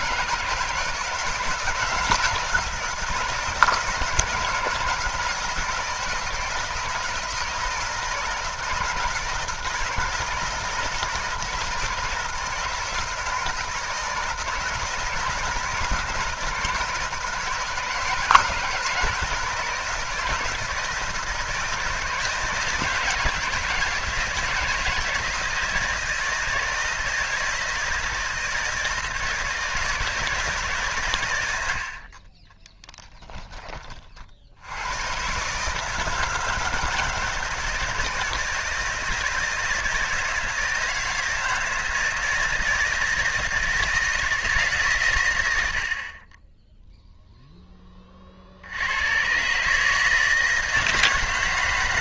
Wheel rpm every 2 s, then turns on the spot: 170, 170, 160, 160, 160, 160, 160, 160, 170, 160, 160, 170, 170, 160, 160, 140, 10, 100, 170, 160, 160, 160, 130, 0, 90, 160.
32-34